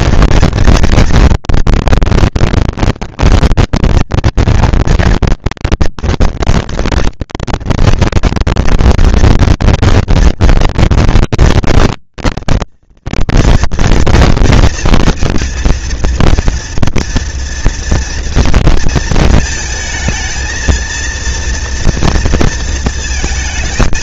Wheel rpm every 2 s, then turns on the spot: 230, 230, 220, 230, 240, 230, 230, 230, 230, 230, 230, 230.
none